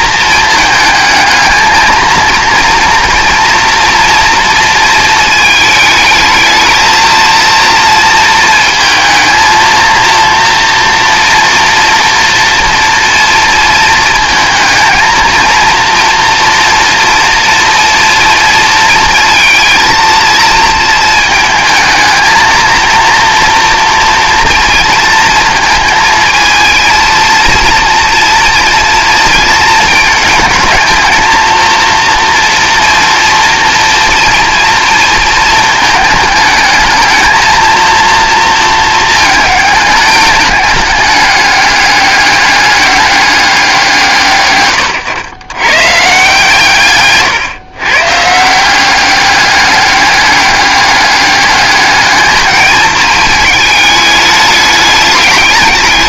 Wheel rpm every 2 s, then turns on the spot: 220, 240, 230, 220, 220, 240, 230, 230, 230, 230, 220, 230, 230, 220, 230, 220, 230, 230, 220, 230, 210, 200, 120, 140, 180, 210, 220, 210.
none